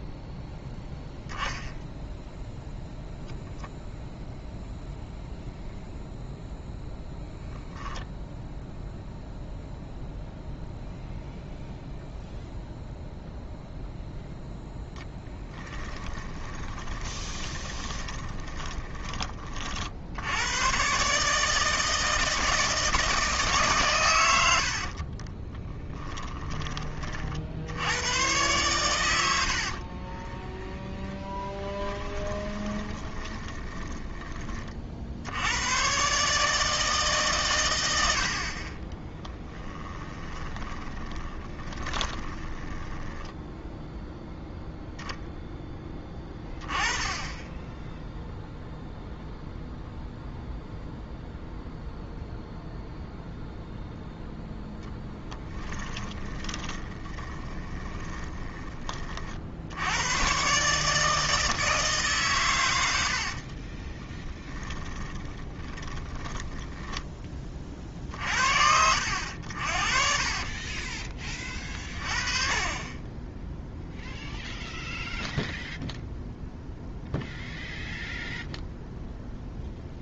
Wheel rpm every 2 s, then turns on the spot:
0, 0, 0, 0, 0, 0, 0, 0, 20, 20, 130, 160, 50, 20, 110, 10, 20, 40, 150, 30, 20, 10, 0, 20, 0, 0, 0, 10, 20, 20, 150, 90, 10, 10, 70, 30, 20, 0, 0, 0.
16-18 24-26 30-34 40-44 56-58 64-68 70-72